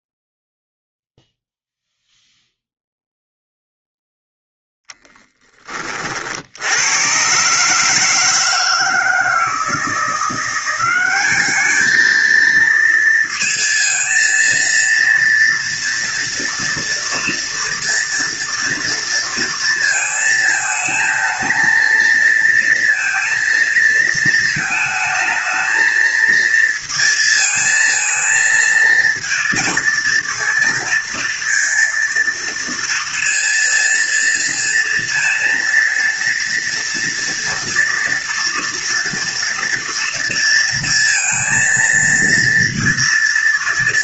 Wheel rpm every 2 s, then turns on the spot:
0, 0, 10, 110, 160, 190, 230, 230, 230, 230, 220, 230, 220, 230, 230, 230, 230, 230, 230, 230, 230, 230.
none